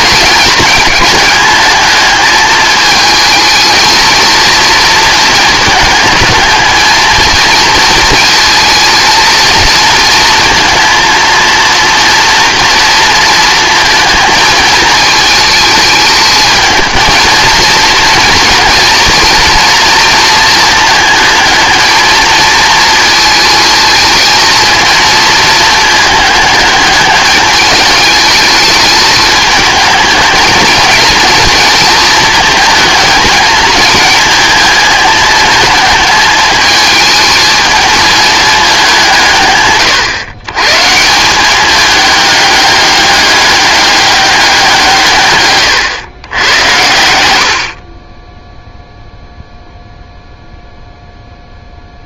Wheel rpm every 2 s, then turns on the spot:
210, 220, 230, 220, 230, 230, 240, 220, 220, 230, 230, 220, 220, 210, 210, 220, 220, 220, 220, 200, 130, 210, 180, 100, 0, 0.
none